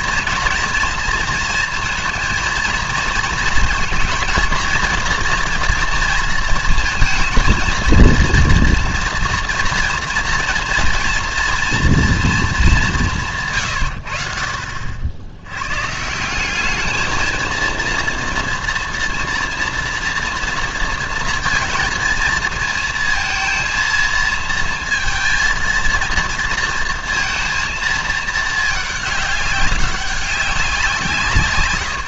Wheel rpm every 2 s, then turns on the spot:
230, 230, 230, 220, 240, 230, 200, 60, 210, 230, 230, 220, 230, 230, 220, 180.
none